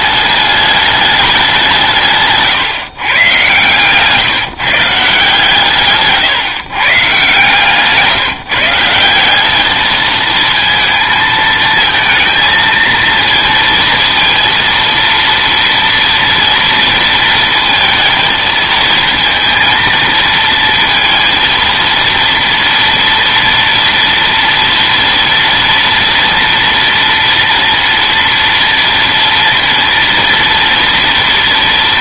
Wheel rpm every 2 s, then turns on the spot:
210, 150, 160, 140, 160, 220, 230, 230, 230, 220, 230, 230, 230, 230, 230, 230.
none